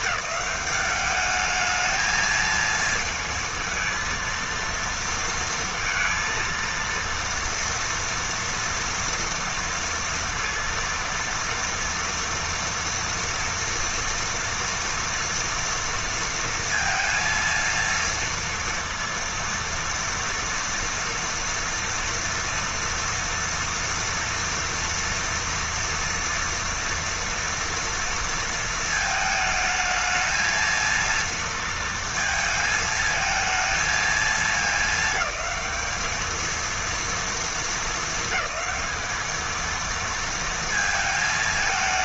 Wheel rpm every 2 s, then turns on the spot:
200, 230, 230, 230, 230, 230, 230, 230, 230, 230, 230, 230, 230, 230, 230, 230, 220, 210, 230, 220, 220.
none